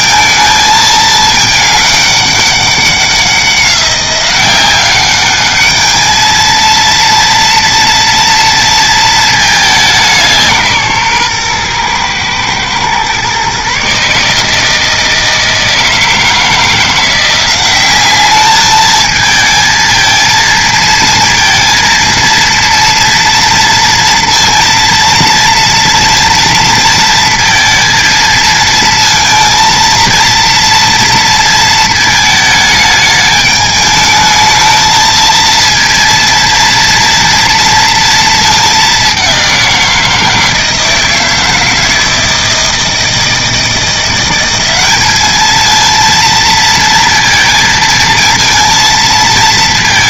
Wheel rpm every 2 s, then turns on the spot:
220, 190, 190, 230, 230, 160, 120, 160, 160, 210, 230, 230, 230, 230, 220, 230, 210, 220, 230, 210, 160, 160, 190, 230, 230.
none